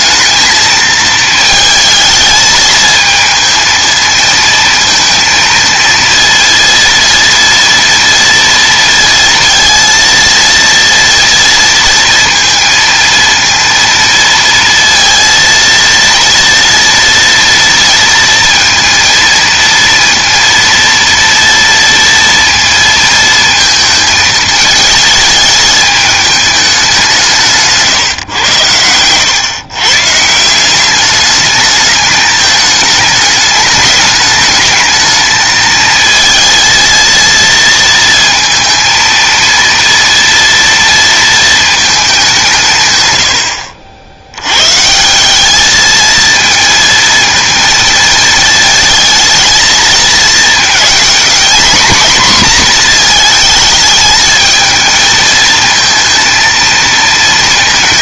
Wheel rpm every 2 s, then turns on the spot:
220, 220, 230, 230, 230, 230, 230, 230, 240, 230, 230, 230, 220, 190, 100, 200, 210, 220, 230, 230, 230, 140, 140, 230, 220, 230, 240, 220, 230.
none